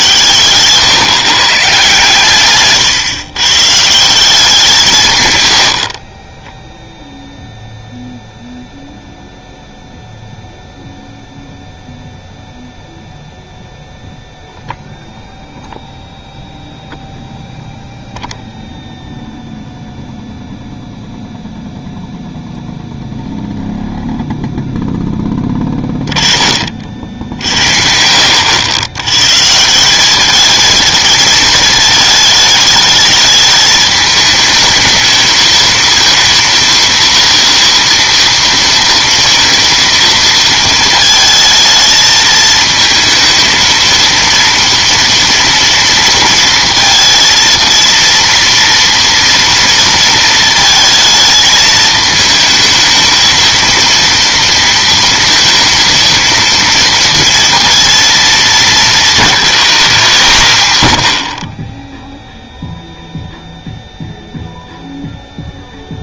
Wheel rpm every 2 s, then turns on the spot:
140, 130, 180, 0, 0, 0, 0, 0, 0, 0, 0, 0, 0, 40, 90, 220, 210, 210, 230, 230, 230, 230, 230, 230, 230, 230, 220, 230, 230, 220, 110, 0, 0.
none